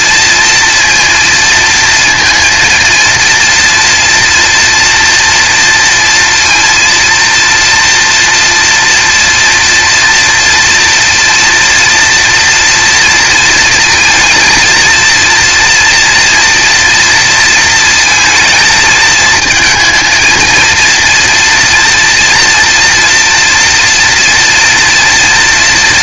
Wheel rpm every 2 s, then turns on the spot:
230, 230, 230, 230, 240, 240, 230, 220, 230, 220, 230, 230, 240.
none